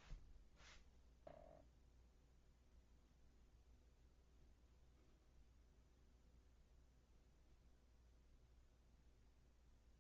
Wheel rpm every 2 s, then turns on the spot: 0, 0, 0, 0, 0.
none